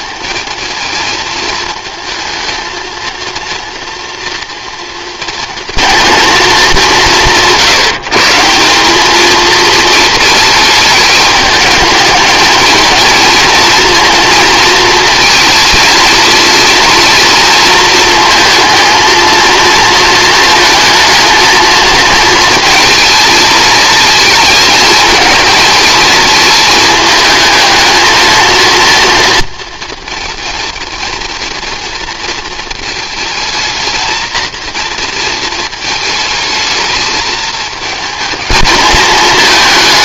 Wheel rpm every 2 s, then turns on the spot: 220, 230, 230, 190, 200, 210, 220, 230, 230, 220, 230, 230, 220, 220, 230, 230, 220, 230, 220, 220.
none